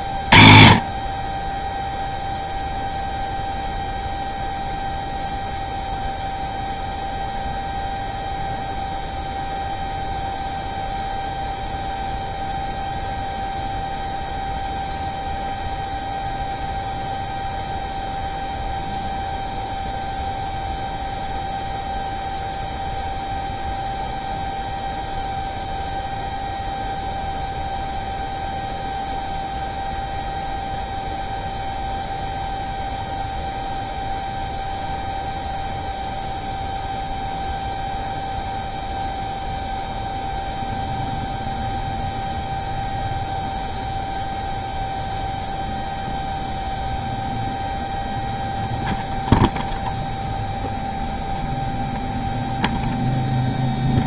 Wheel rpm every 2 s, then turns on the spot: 30, 0, 0, 0, 0, 0, 0, 0, 0, 0, 0, 0, 0, 0, 0, 0, 0, 0, 0, 0, 0, 0, 0, 0, 0, 0, 0.
none